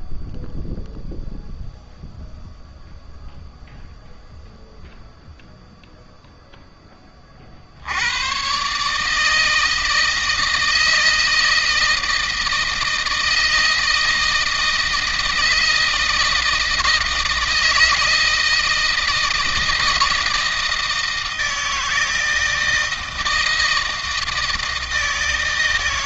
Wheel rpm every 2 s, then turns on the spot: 0, 0, 0, 10, 130, 160, 160, 160, 160, 160, 160, 160, 160.
none